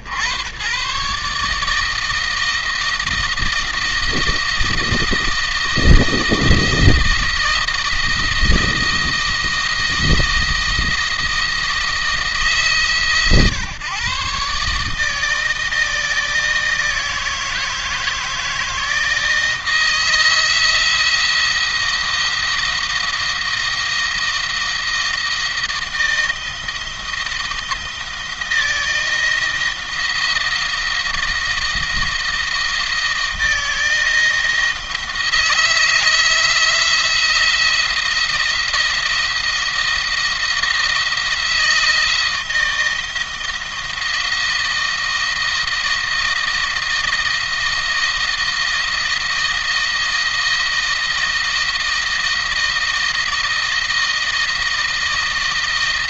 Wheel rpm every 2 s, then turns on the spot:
110, 160, 160, 160, 160, 160, 150, 140, 160, 160, 170, 170, 170, 170, 170, 170, 170, 160, 170, 170, 170, 170, 160, 160, 160, 160, 160, 160.
none